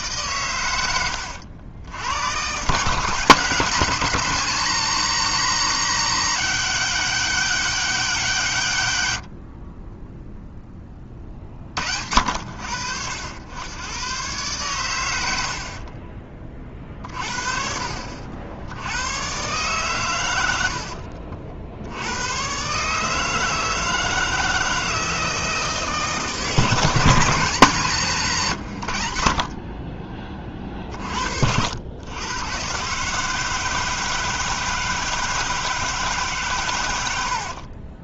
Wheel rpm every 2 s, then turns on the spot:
100, 160, 190, 200, 130, 20, 80, 110, 40, 100, 50, 150, 160, 170, 80, 40, 140, 160, 100.
0-2 20-22